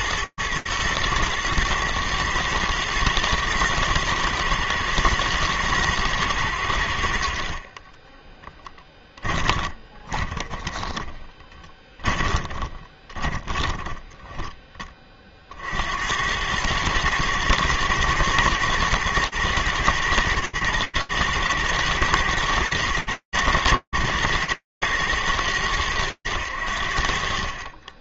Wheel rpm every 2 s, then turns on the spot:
110, 120, 120, 70, 10, 20, 30, 30, 110, 120, 110, 110, 120, 80.
8-14